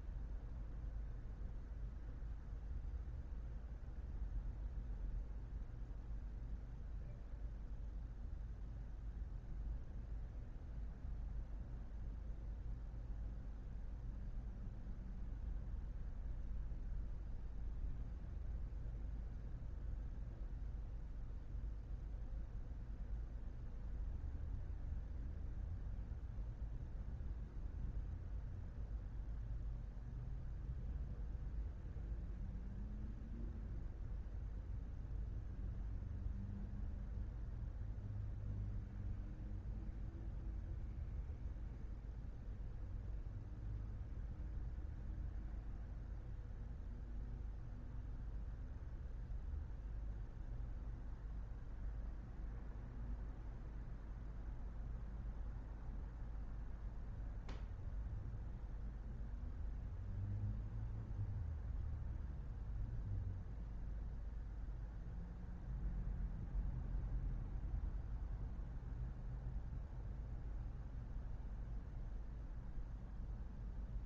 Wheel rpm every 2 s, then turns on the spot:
0, 0, 0, 0, 0, 0, 0, 0, 0, 0, 0, 0, 0, 0, 0, 0, 0, 0, 0, 0, 0, 0, 0, 0, 0, 0, 0, 0, 0, 0, 0, 0, 0, 0, 0, 0, 0.
none